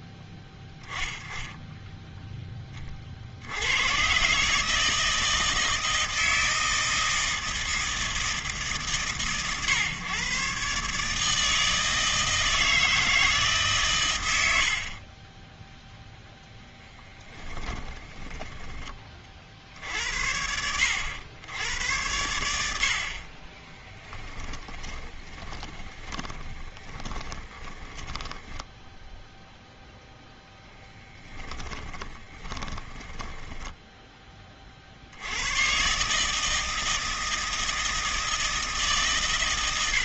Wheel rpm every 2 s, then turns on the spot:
10, 40, 160, 160, 140, 130, 160, 50, 10, 20, 70, 70, 10, 10, 10, 10, 10, 50, 160, 160.
24-28 30-34